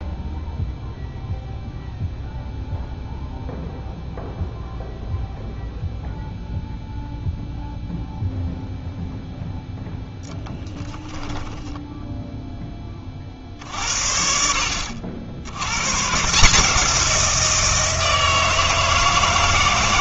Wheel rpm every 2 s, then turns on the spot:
0, 0, 0, 0, 0, 10, 20, 70, 170, 160.
10-12